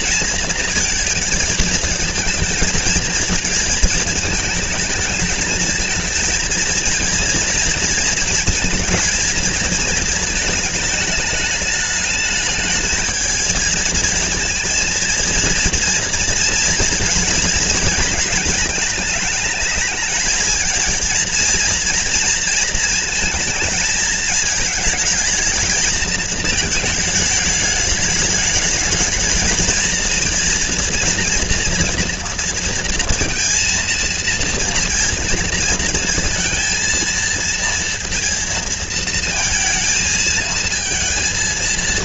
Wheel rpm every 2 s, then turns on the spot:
220, 220, 220, 230, 230, 210, 220, 230, 230, 220, 230, 220, 220, 210, 210, 240, 230, 230, 220, 230, 230.
none